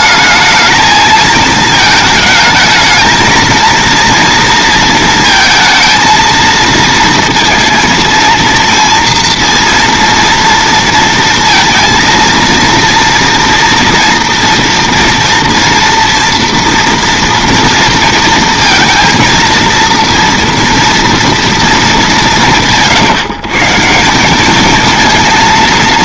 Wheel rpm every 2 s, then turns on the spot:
220, 220, 230, 230, 230, 230, 230, 230, 240, 230, 230, 150, 220.
none